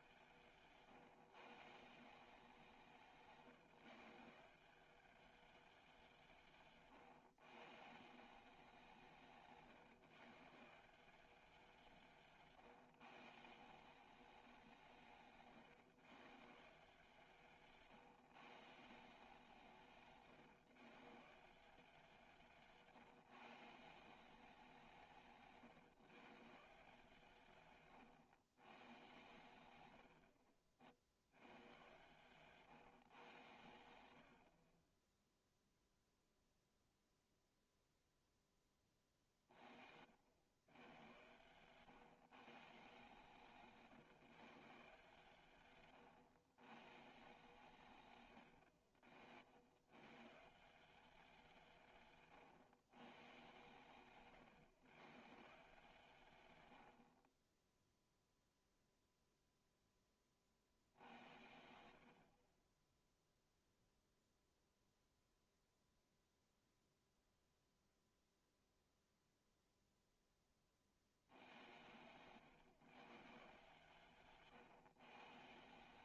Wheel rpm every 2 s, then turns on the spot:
150, 170, 180, 140, 180, 160, 150, 180, 160, 150, 140, 160, 180, 150, 120, 60, 130, 40, 0, 10, 100, 150, 150, 130, 70, 180, 130, 120, 90, 0, 60, 20, 0, 0, 0, 40, 130, 140.
22-24 62-64